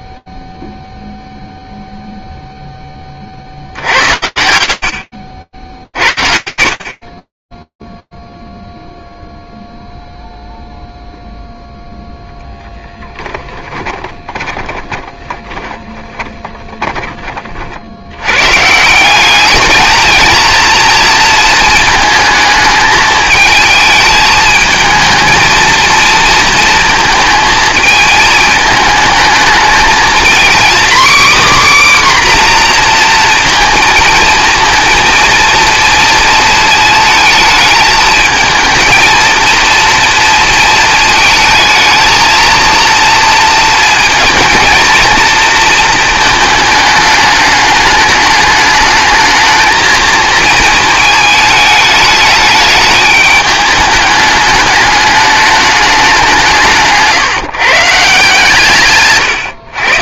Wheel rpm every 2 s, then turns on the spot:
0, 20, 60, 50, 0, 0, 10, 20, 30, 200, 220, 220, 220, 220, 220, 270, 230, 230, 220, 230, 220, 230, 230, 210, 220, 220, 210, 210, 160, 150.
6-8 12-16